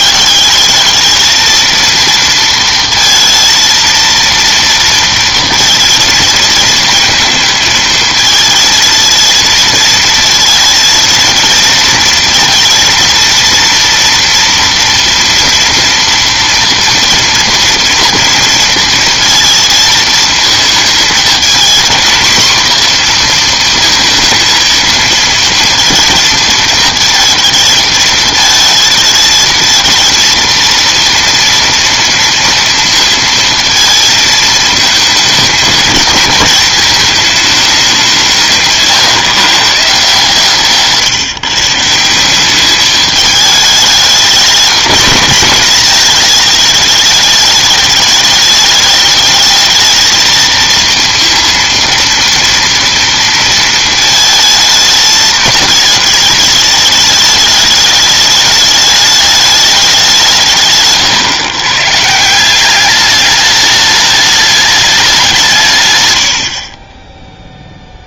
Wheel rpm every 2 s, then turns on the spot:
200, 230, 230, 230, 220, 230, 230, 240, 240, 230, 220, 240, 230, 230, 220, 230, 230, 220, 210, 160, 150, 200, 210, 210, 210, 230, 230, 220, 210, 210, 160, 190, 210, 50.
38-40